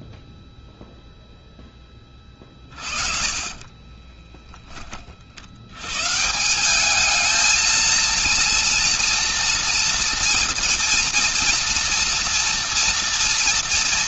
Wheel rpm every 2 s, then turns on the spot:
0, 40, 30, 180, 230, 230, 230.
2-4